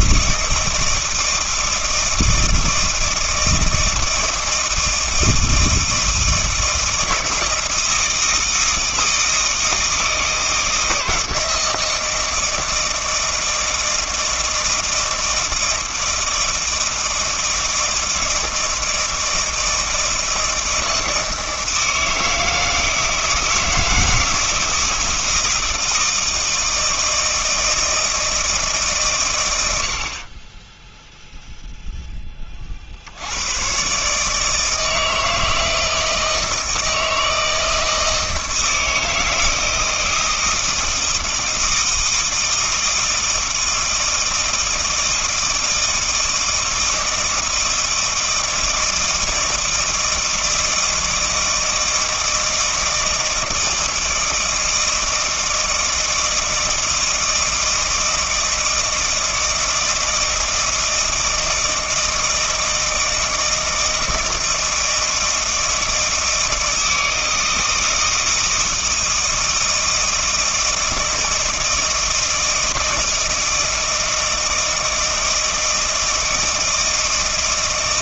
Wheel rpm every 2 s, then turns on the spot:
160, 160, 160, 160, 160, 160, 160, 160, 160, 160, 160, 160, 160, 160, 150, 10, 50, 160, 160, 160, 160, 160, 160, 160, 160, 160, 160, 160, 160, 160, 160, 160, 160, 160, 160, 160, 160, 160, 160.
30-32